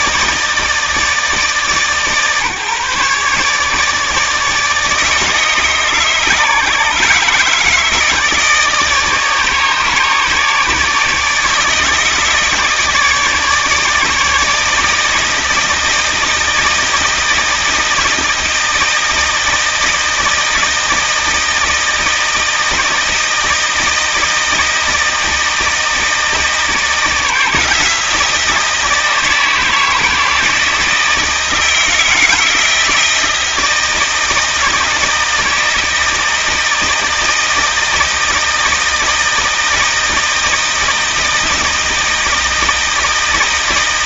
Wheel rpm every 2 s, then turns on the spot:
160, 140, 150, 150, 150, 150, 150, 160, 160, 160, 160, 160, 160, 160, 170, 160, 160, 160, 160, 160, 160, 160.
none